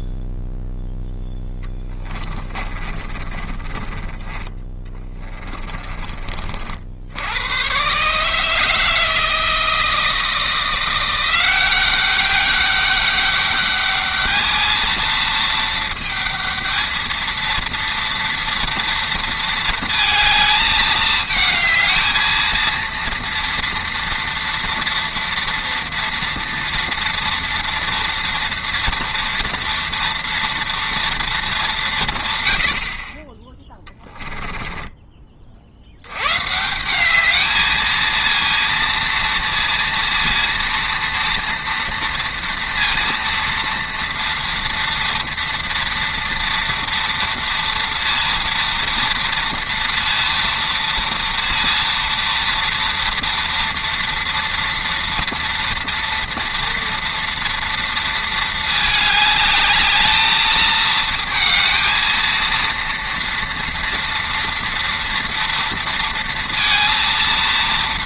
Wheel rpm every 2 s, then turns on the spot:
0, 30, 20, 50, 160, 170, 200, 220, 220, 230, 220, 230, 230, 230, 240, 230, 70, 10, 160, 230, 230, 230, 230, 230, 230, 230, 230, 230, 230, 220, 220, 230, 230, 230.
2-6 34-36